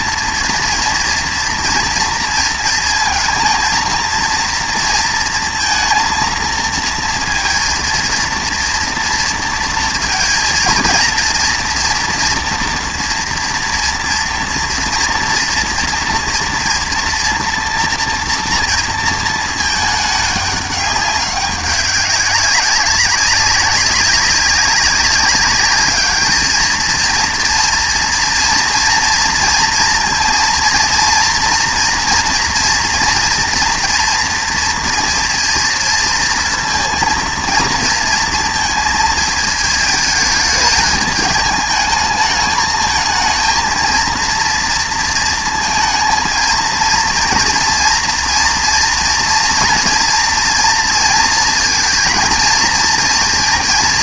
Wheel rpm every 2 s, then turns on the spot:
230, 230, 230, 230, 230, 230, 230, 230, 240, 230, 200, 190, 200, 230, 230, 230, 230, 230, 230, 230, 220, 220, 230, 230, 230, 230, 230.
none